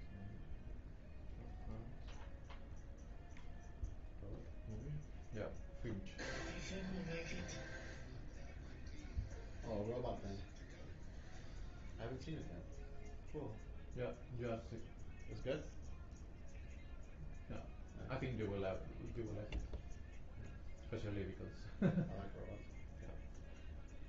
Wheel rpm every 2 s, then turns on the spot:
0, 0, 0, 0, 0, 0, 0, 0, 0, 0, 0, 0.
none